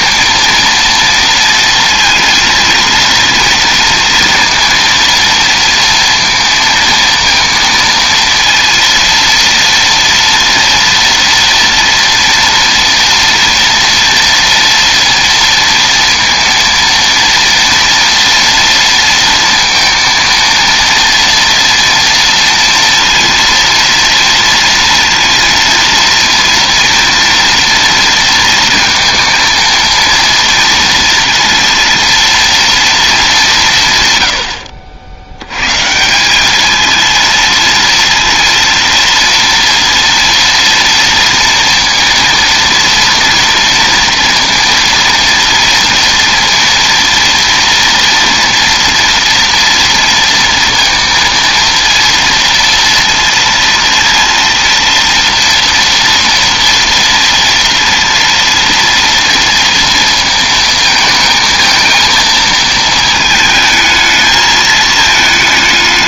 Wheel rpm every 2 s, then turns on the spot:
230, 230, 230, 230, 230, 230, 230, 230, 230, 230, 230, 230, 230, 230, 230, 230, 230, 70, 220, 230, 230, 230, 230, 230, 230, 230, 230, 230, 230, 230, 220, 220, 220.
none